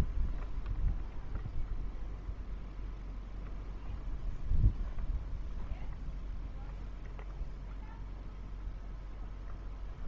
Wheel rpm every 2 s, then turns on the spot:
0, 0, 0, 0, 0.
none